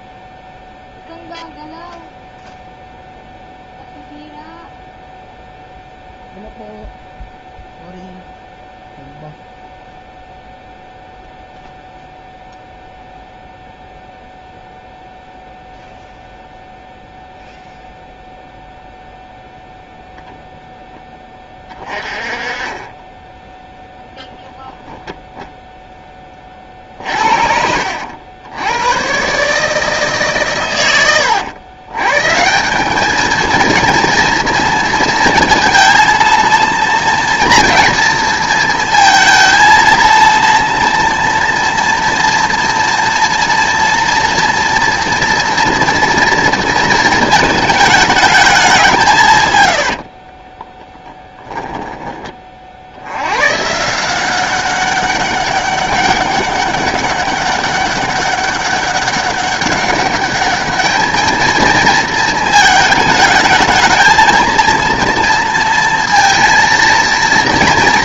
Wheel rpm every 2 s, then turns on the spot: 0, 0, 0, 0, 0, 0, 0, 0, 0, 0, 0, 20, 0, 40, 100, 120, 190, 230, 230, 230, 230, 230, 230, 230, 190, 30, 50, 190, 200, 200, 210, 220, 230, 230.
50-52